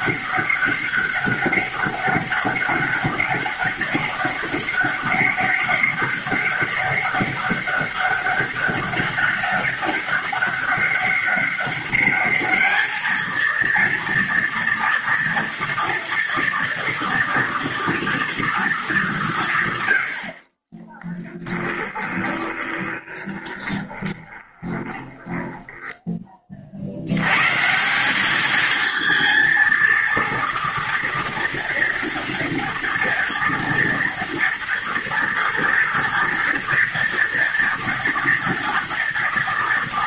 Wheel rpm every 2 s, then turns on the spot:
200, 200, 200, 200, 200, 200, 220, 230, 230, 200, 20, 20, 20, 80, 220, 230, 230, 230, 230, 230.
20-26